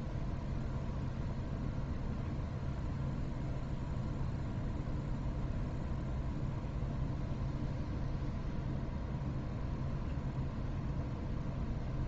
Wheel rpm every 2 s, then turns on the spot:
0, 0, 0, 0, 0, 0.
none